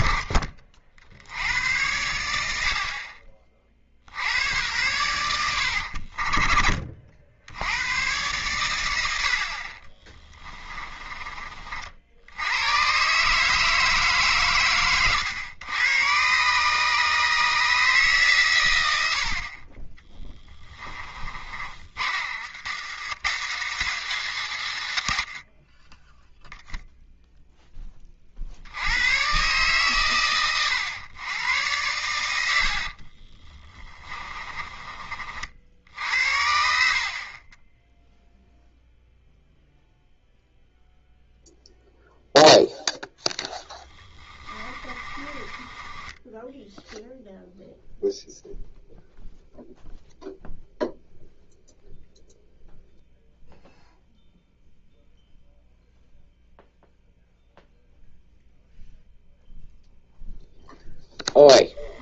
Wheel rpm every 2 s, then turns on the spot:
40, 50, 100, 40, 110, 20, 110, 120, 140, 100, 20, 120, 150, 0, 90, 100, 50, 30, 50, 0, 0, 0, 20, 0, 0, 0, 0, 0, 0, 0, 10.
10-12 20-24 32-34 44-46